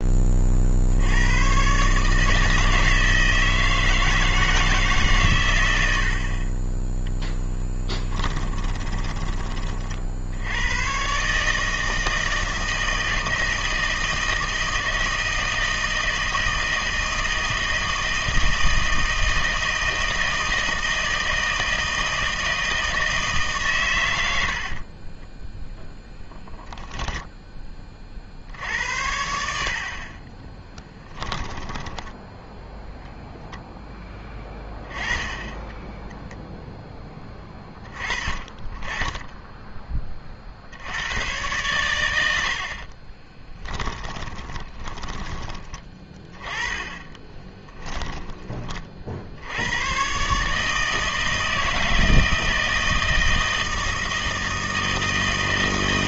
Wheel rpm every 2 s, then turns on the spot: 60, 160, 150, 10, 20, 110, 160, 160, 160, 160, 160, 160, 50, 0, 80, 20, 0, 10, 10, 30, 70, 60, 10, 20, 30, 160, 160, 160.
8-10 24-26 30-32 44-46